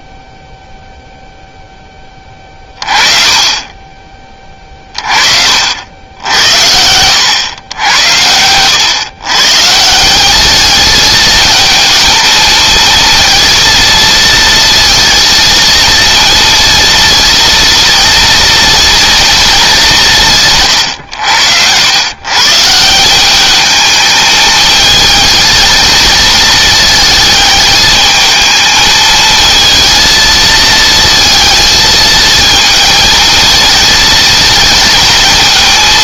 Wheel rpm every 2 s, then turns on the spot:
0, 30, 40, 90, 120, 220, 230, 230, 230, 230, 110, 180, 220, 220, 220, 220, 230, 230.
2-4 6-8